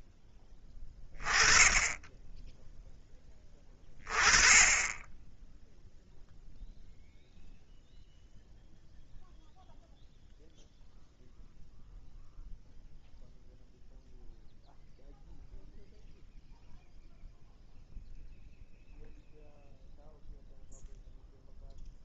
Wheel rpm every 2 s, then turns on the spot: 10, 20, 0, 0, 0, 0, 0, 0, 0, 0, 0.
none